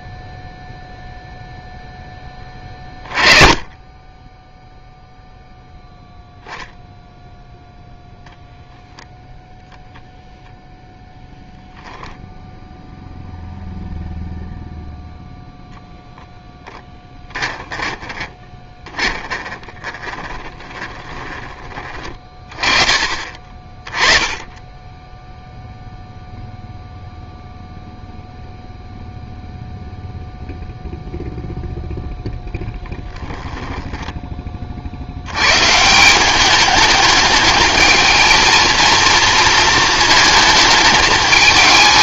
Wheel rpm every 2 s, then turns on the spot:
0, 20, 10, 0, 0, 10, 0, 0, 10, 20, 20, 20, 10, 0, 0, 0, 0, 40, 200, 220, 210.
16-22